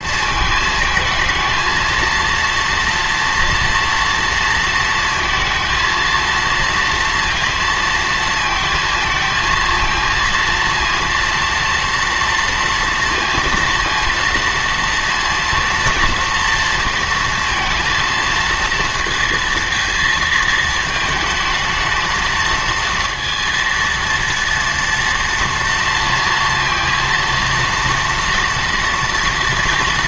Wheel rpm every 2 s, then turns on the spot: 220, 230, 230, 230, 220, 230, 230, 230, 230, 230, 220, 230, 230, 230, 230.
none